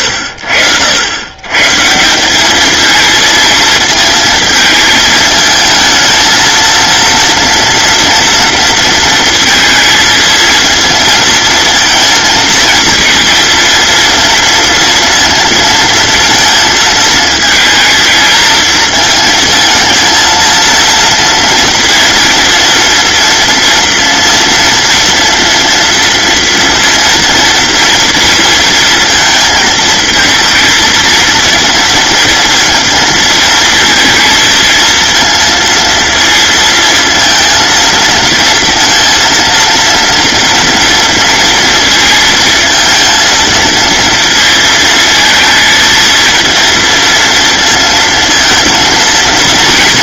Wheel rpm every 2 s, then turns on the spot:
80, 210, 220, 230, 230, 230, 230, 230, 230, 220, 230, 230, 230, 230, 230, 220, 230, 230, 230, 230, 230, 230, 230, 230, 230.
none